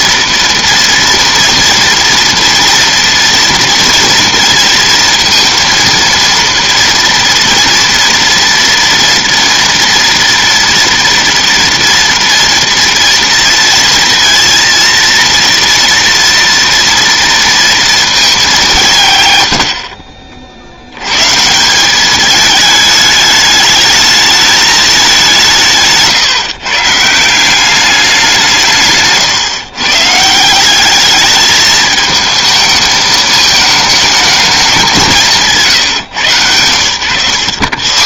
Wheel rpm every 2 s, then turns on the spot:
230, 230, 230, 230, 230, 230, 230, 230, 230, 190, 60, 220, 210, 140, 160, 190, 220, 200, 100.
none